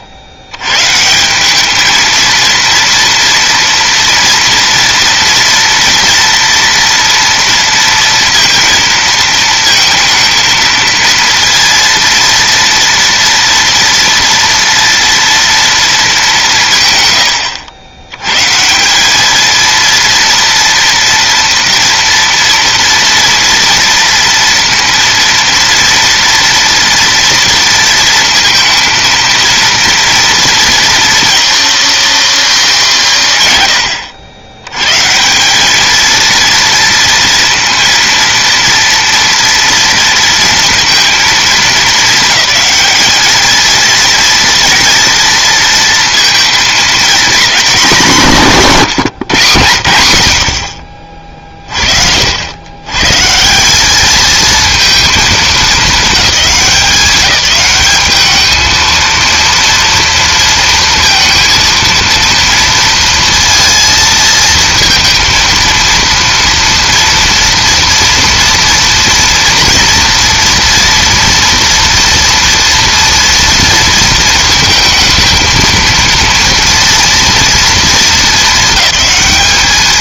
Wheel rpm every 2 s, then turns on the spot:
120, 230, 230, 230, 230, 230, 230, 230, 150, 180, 230, 230, 230, 230, 230, 230, 220, 110, 230, 230, 230, 210, 230, 220, 180, 50, 90, 230, 180, 220, 230, 230, 230, 230, 230, 230, 230, 230, 230, 220.
none